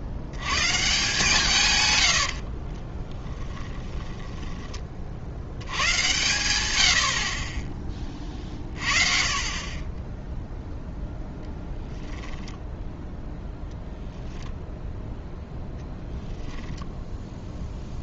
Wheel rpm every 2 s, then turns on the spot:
110, 50, 30, 100, 30, 0, 10, 0, 0.
2-6 12-14